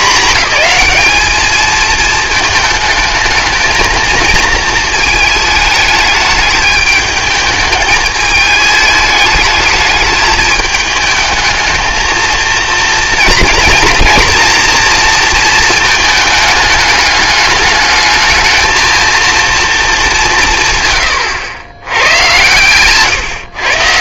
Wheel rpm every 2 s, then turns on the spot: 220, 220, 220, 210, 220, 220, 230, 230, 210, 220, 150, 130.
none